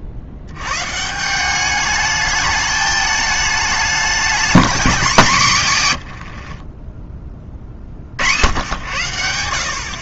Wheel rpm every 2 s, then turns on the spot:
110, 210, 220, 60, 80.
6-8